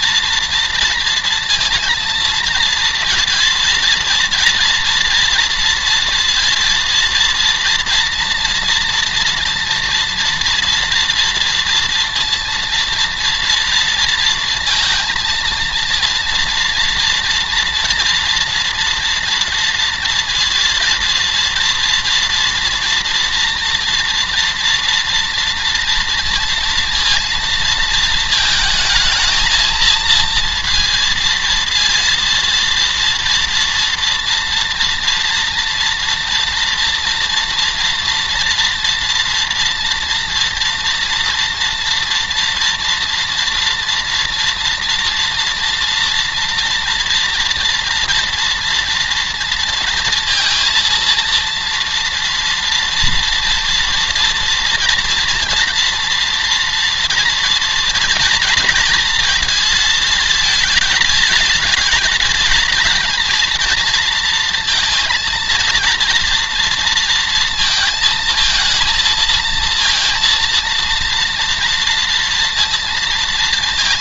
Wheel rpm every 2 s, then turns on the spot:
230, 230, 230, 230, 230, 230, 230, 230, 230, 230, 230, 230, 230, 230, 220, 230, 230, 230, 240, 230, 230, 230, 230, 230, 230, 230, 230, 240, 230, 230, 220, 230, 230, 230, 230, 230, 230.
none